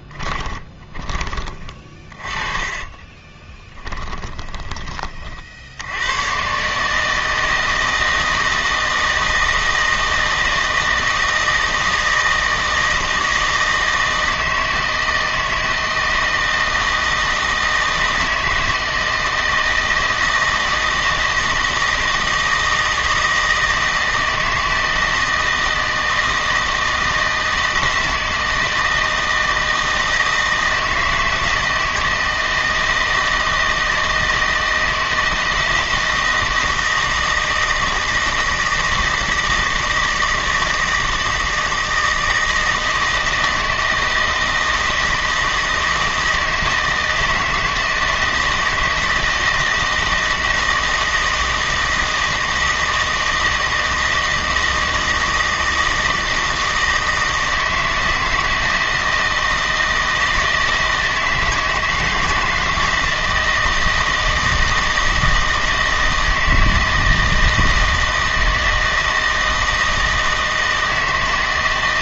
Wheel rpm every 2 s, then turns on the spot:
20, 30, 20, 130, 160, 160, 160, 160, 160, 160, 160, 160, 160, 160, 160, 160, 160, 160, 170, 160, 160, 160, 160, 160, 160, 160, 160, 160, 160, 170, 160, 160, 160, 160, 160, 160.
0-6